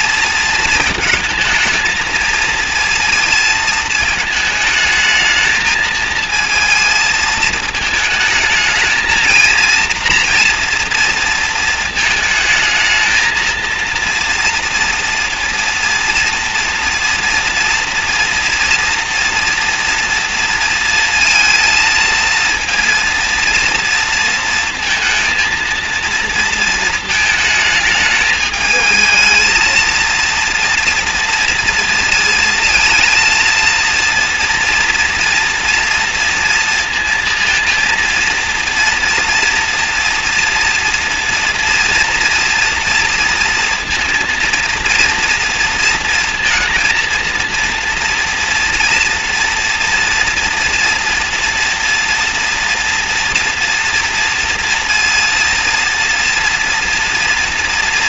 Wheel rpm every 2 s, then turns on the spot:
230, 230, 220, 230, 220, 230, 220, 230, 230, 230, 230, 230, 230, 230, 220, 230, 230, 230, 230, 230, 230, 230, 230, 230, 230, 240, 230, 230, 230.
none